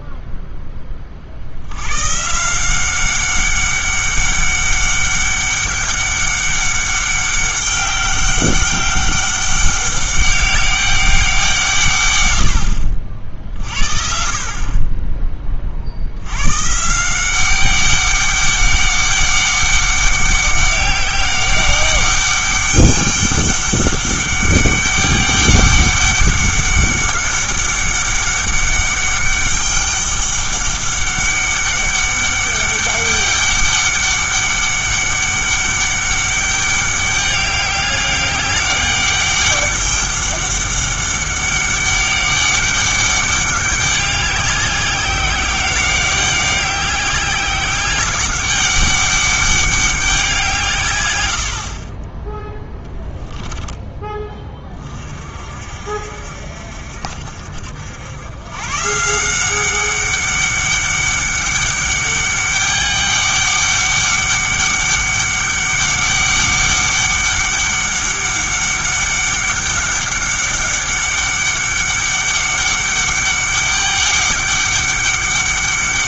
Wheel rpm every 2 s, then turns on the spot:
10, 170, 200, 200, 200, 200, 70, 40, 130, 200, 190, 200, 200, 200, 200, 200, 200, 200, 200, 200, 200, 200, 200, 200, 200, 150, 10, 30, 60, 120, 200, 200, 200, 200, 200, 190, 200, 200.
52-54